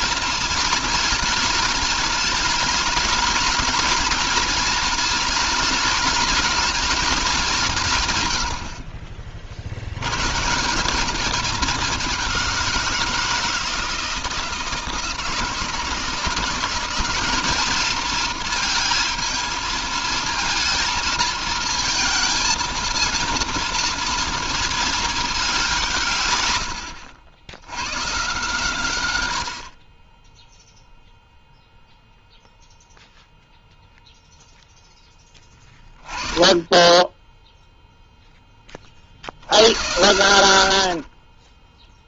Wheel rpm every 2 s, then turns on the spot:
220, 220, 220, 210, 40, 200, 170, 170, 190, 230, 230, 220, 220, 80, 110, 0, 0, 10, 10, 40, 50.
none